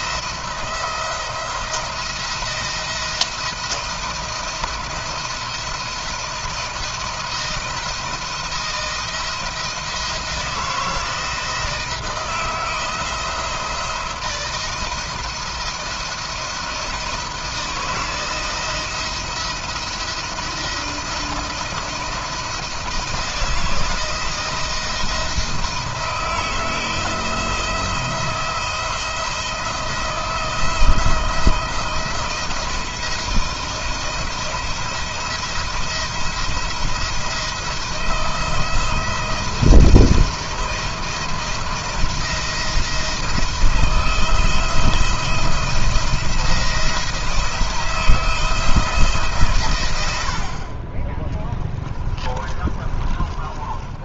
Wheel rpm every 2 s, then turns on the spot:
170, 170, 170, 160, 170, 170, 170, 170, 160, 170, 170, 160, 160, 170, 170, 170, 160, 170, 170, 170, 170, 160, 170, 170, 160, 40, 30.
52-54